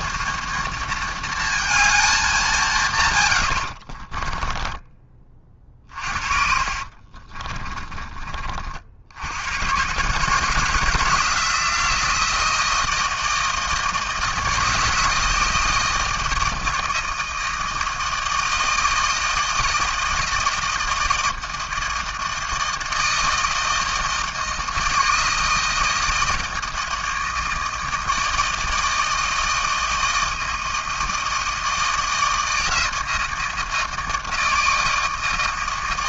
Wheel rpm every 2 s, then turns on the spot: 230, 180, 20, 40, 40, 160, 160, 160, 160, 160, 160, 160, 160, 160, 160, 160, 160, 160.
4-8